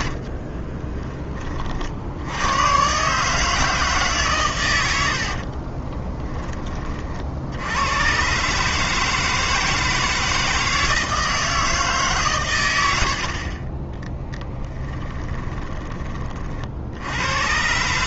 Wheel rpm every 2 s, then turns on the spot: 30, 110, 100, 30, 150, 160, 110, 20, 60.
14-16